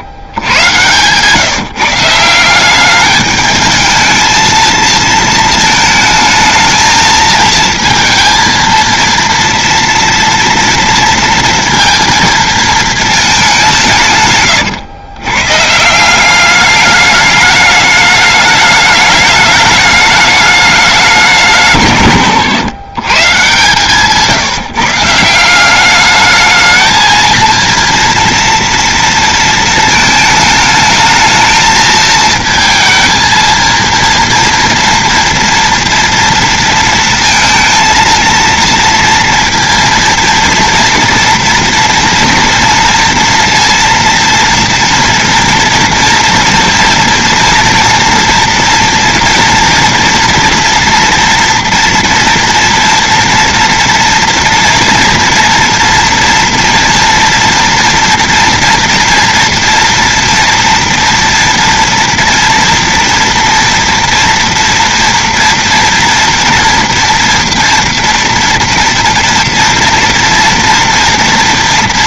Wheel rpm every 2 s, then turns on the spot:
150, 160, 220, 220, 230, 230, 230, 160, 180, 210, 210, 130, 140, 200, 230, 220, 220, 230, 230, 230, 230, 230, 230, 230, 230, 230, 230, 230, 240, 240, 230, 230, 230, 230, 230, 230.
0-2 24-26